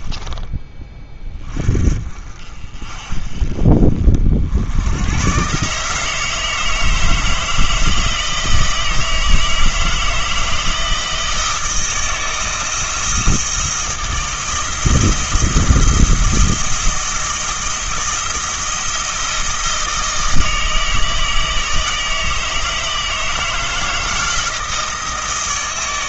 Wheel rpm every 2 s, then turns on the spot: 20, 40, 90, 160, 160, 160, 160, 160, 160, 160, 160, 160, 160.
none